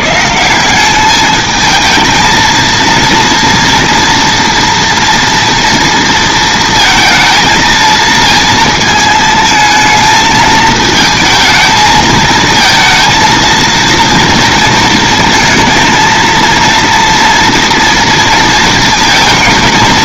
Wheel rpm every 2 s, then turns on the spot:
170, 230, 230, 230, 220, 220, 230, 230, 230, 230.
none